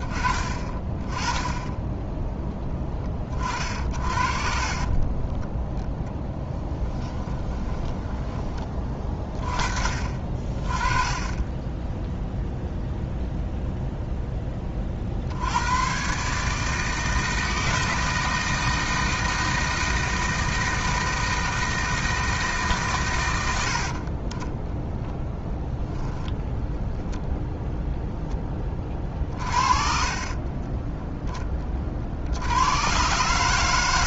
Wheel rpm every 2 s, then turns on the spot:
20, 10, 40, 20, 30, 30, 0, 10, 150, 160, 160, 150, 10, 0, 10, 20, 90.
6-10